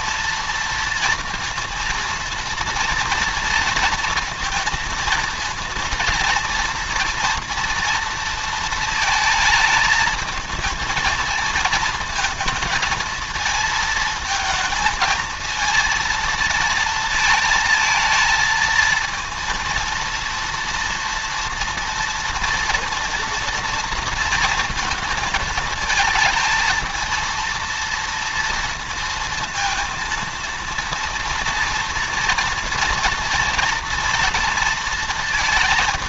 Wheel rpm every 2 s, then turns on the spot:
230, 230, 230, 230, 230, 220, 220, 220, 220, 230, 230, 230, 230, 220, 230, 230, 230, 230.
none